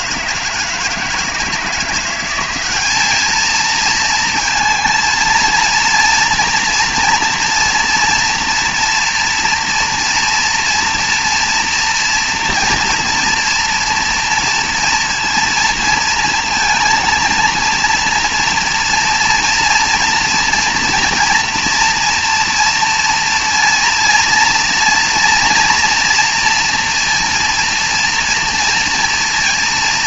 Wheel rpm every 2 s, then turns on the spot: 160, 200, 220, 230, 230, 230, 230, 230, 230, 230, 230, 230, 230, 230, 230.
none